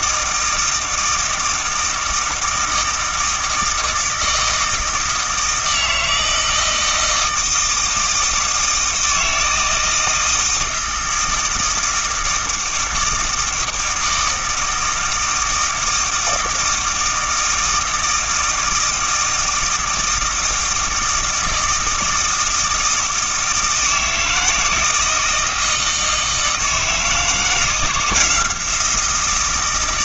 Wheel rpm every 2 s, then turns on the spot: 160, 160, 160, 160, 160, 160, 160, 160, 160, 160, 160, 160, 160, 160, 170.
none